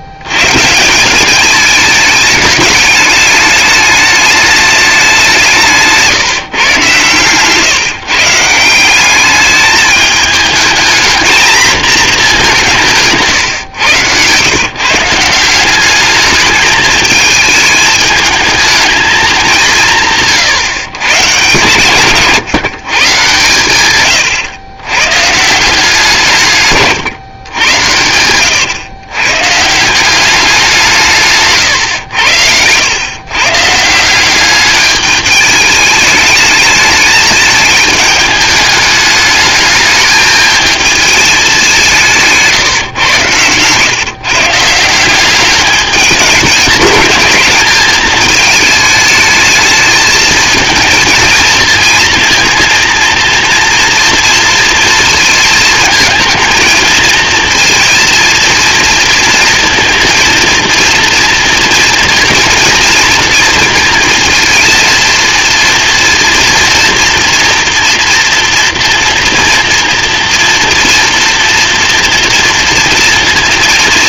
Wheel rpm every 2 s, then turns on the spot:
160, 210, 210, 140, 180, 220, 180, 140, 210, 220, 140, 140, 100, 140, 110, 180, 100, 200, 210, 210, 220, 150, 160, 210, 220, 230, 230, 230, 220, 230, 230, 230, 230, 230, 230, 240, 240.
none